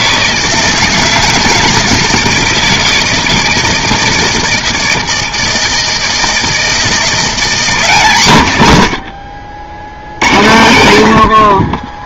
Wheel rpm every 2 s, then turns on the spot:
160, 160, 160, 160, 130, 100.
none